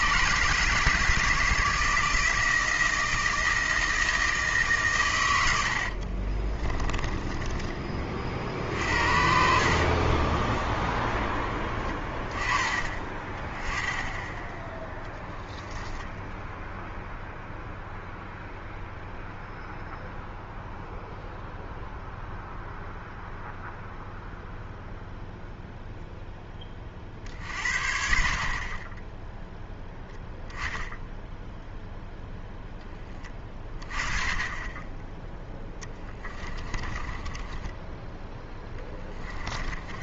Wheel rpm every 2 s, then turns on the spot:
150, 160, 150, 30, 50, 10, 20, 10, 0, 0, 0, 0, 0, 10, 40, 10, 10, 20, 20, 10.
6-12 36-38